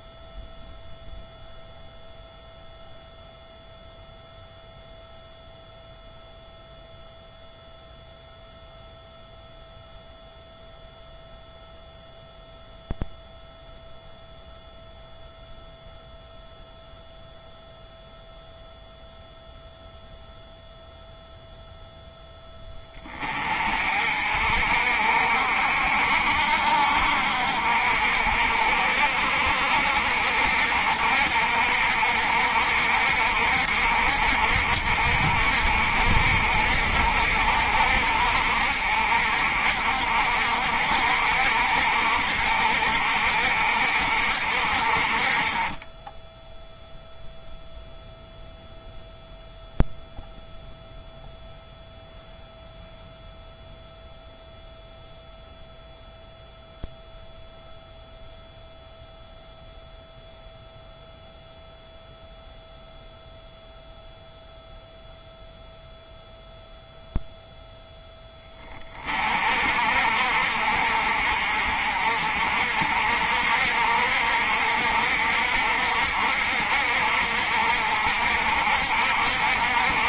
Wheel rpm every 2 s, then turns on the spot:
0, 0, 0, 0, 0, 0, 0, 0, 0, 0, 0, 20, 60, 60, 60, 60, 60, 60, 60, 60, 60, 60, 50, 0, 0, 0, 0, 0, 0, 0, 0, 0, 0, 0, 30, 60, 60, 60, 60, 60.
none